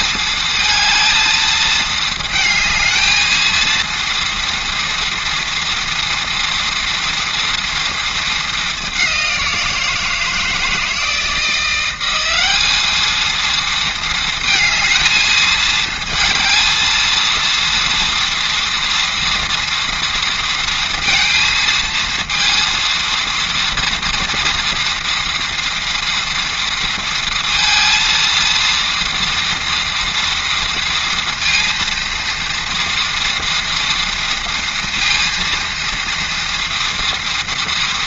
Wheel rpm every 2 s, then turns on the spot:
220, 220, 230, 230, 210, 160, 200, 220, 220, 230, 230, 230, 230, 230, 230, 230, 230, 230, 230.
none